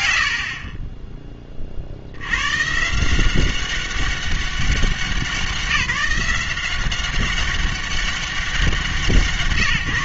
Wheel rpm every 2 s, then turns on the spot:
60, 130, 190, 180, 190.
none